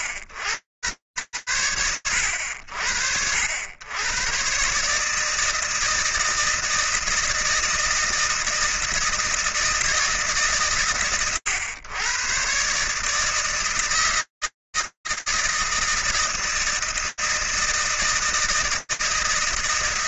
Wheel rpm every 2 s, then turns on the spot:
70, 70, 150, 160, 160, 110, 140, 140, 160, 160.
none